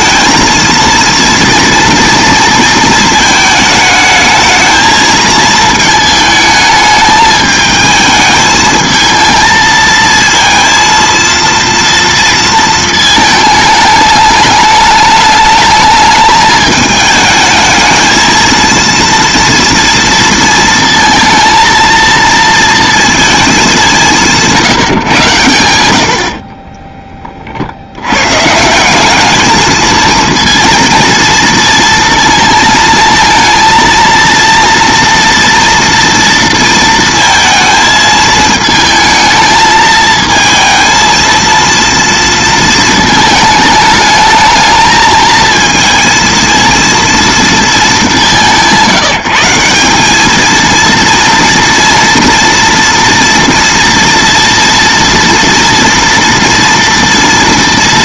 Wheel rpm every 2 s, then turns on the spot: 230, 230, 220, 220, 220, 230, 230, 210, 210, 230, 230, 230, 160, 30, 170, 230, 220, 230, 230, 220, 230, 230, 220, 230, 170, 230, 230, 230, 230.
26-28